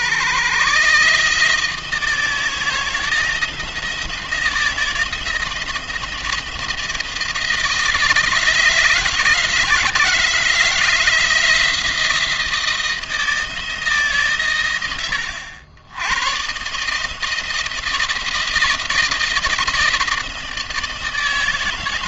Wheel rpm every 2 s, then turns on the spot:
140, 160, 160, 170, 160, 170, 170, 110, 150, 170, 160.
none